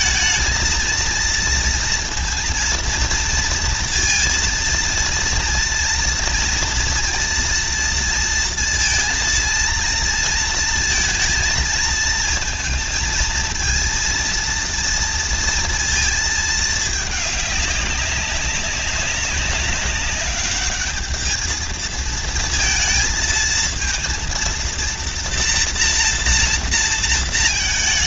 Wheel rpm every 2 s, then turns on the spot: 230, 230, 230, 230, 230, 230, 230, 230, 220, 200, 210, 220, 230, 230.
none